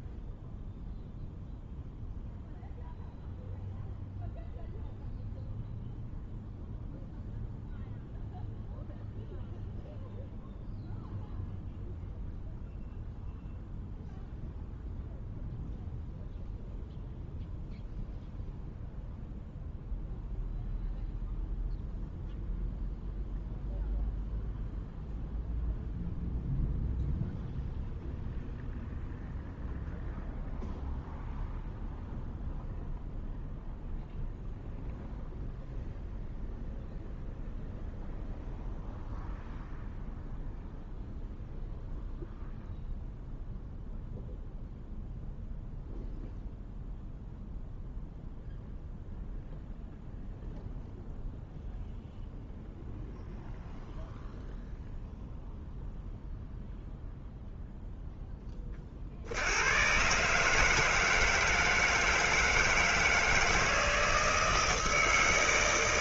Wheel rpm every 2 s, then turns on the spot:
0, 0, 0, 0, 0, 0, 0, 0, 0, 0, 0, 0, 0, 0, 0, 0, 0, 0, 0, 0, 0, 0, 0, 0, 0, 0, 0, 0, 0, 70, 160, 160, 160.
none